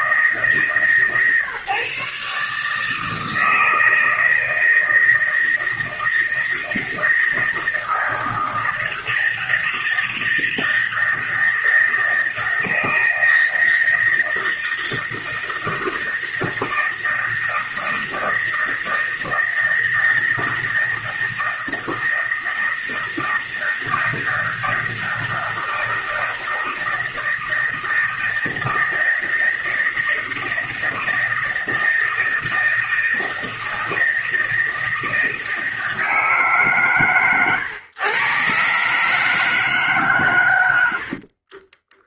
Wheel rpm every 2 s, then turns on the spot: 160, 150, 160, 160, 160, 160, 160, 160, 160, 160, 160, 160, 160, 160, 160, 160, 160, 160, 140, 140, 100.
40-42